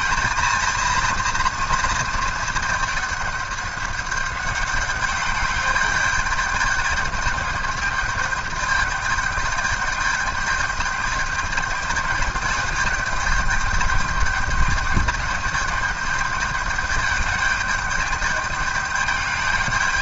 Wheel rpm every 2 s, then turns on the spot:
230, 210, 200, 210, 210, 210, 210, 210, 210, 210.
none